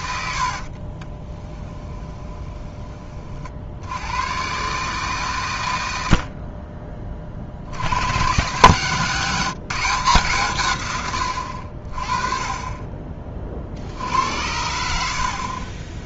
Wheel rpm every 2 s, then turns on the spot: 40, 30, 140, 40, 150, 120, 20, 70.
0-2